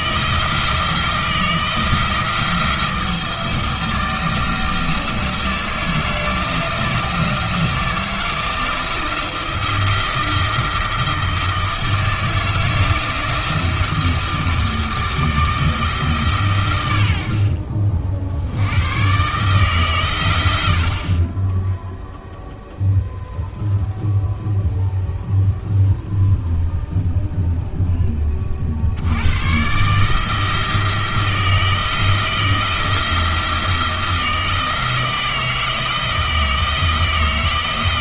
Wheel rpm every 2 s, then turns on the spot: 160, 170, 170, 170, 160, 170, 160, 160, 110, 100, 60, 0, 0, 0, 60, 160, 160, 160, 160.
none